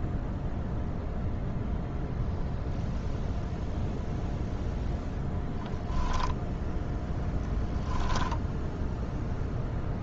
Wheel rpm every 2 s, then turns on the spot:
0, 0, 0, 10, 0.
6-8